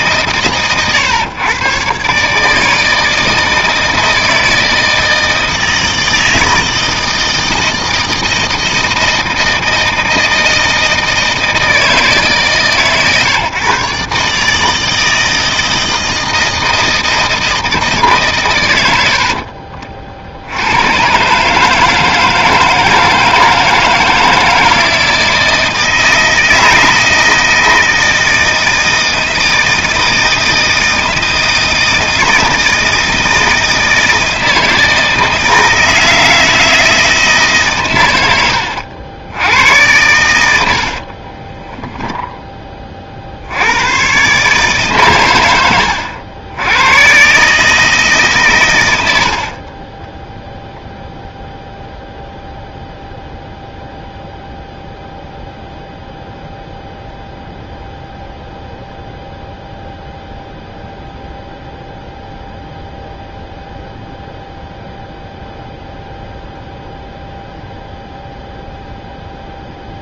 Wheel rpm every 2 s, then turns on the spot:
130, 150, 160, 160, 160, 160, 140, 150, 160, 130, 70, 160, 160, 160, 160, 160, 160, 160, 160, 100, 100, 10, 130, 90, 140, 10, 0, 0, 0, 0, 0, 0, 0, 0, 0.
50-52